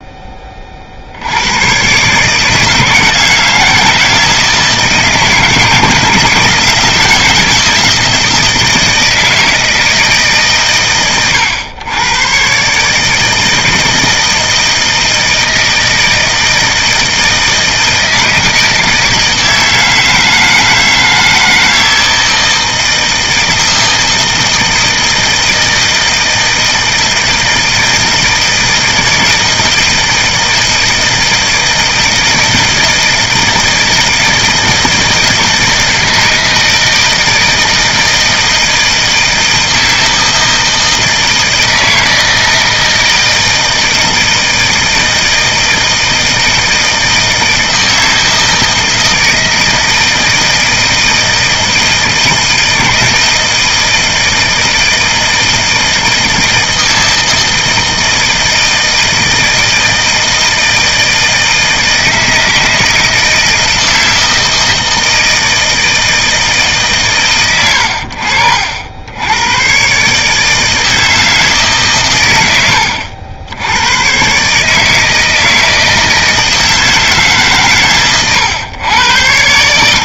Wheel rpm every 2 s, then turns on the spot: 40, 160, 160, 160, 160, 130, 150, 160, 160, 160, 160, 160, 160, 160, 160, 170, 160, 160, 160, 160, 160, 160, 160, 160, 160, 160, 160, 160, 160, 160, 160, 160, 160, 140, 70, 160, 100, 150, 160, 110.
none